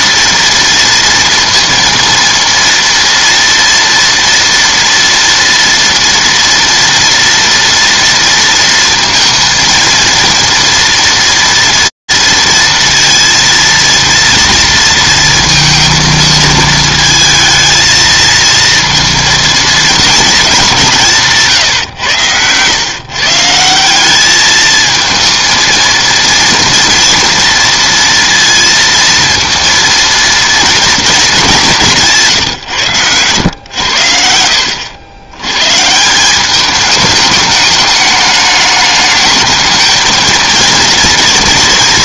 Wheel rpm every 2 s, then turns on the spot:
230, 230, 230, 230, 230, 240, 230, 230, 220, 230, 160, 140, 220, 230, 230, 220, 110, 90, 210, 210, 230.
32-34